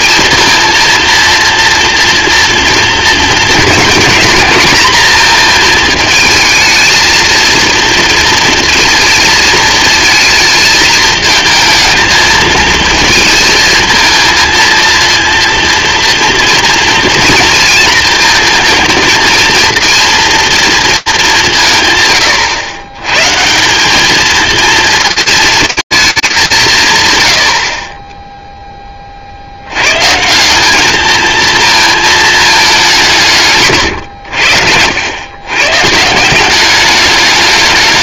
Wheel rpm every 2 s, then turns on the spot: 230, 230, 230, 220, 230, 220, 220, 230, 230, 230, 230, 120, 220, 200, 10, 180, 210, 80, 180.
none